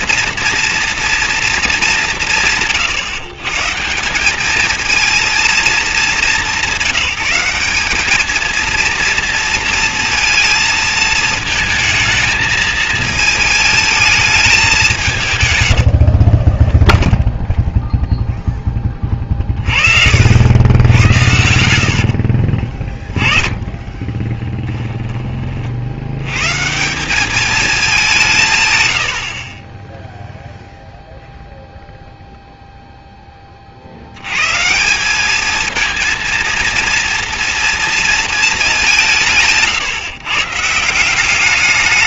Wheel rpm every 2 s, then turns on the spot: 230, 150, 210, 170, 220, 230, 220, 210, 20, 0, 80, 40, 20, 120, 160, 0, 0, 120, 230, 220, 140.
16-18 22-26